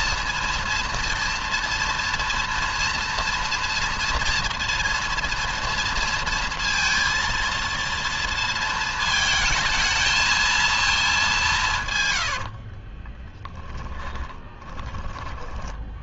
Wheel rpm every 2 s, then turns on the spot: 230, 230, 230, 230, 220, 210, 40, 20.
12-14